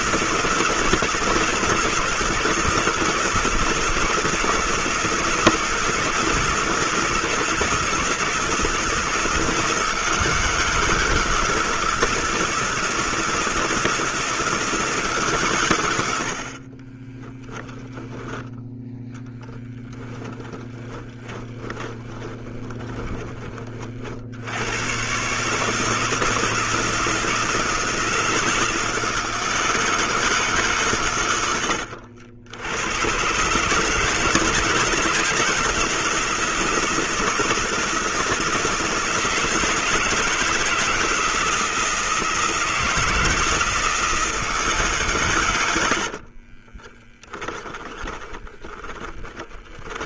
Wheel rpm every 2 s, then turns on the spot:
170, 170, 160, 160, 160, 170, 160, 160, 20, 0, 20, 20, 100, 160, 160, 130, 100, 160, 160, 160, 160, 160, 150, 30, 10.
16-18 20-24 46-50